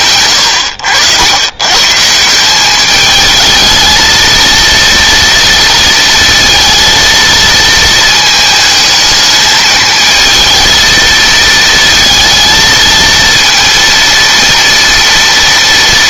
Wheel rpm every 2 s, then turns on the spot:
80, 200, 230, 230, 220, 220, 230, 230.
none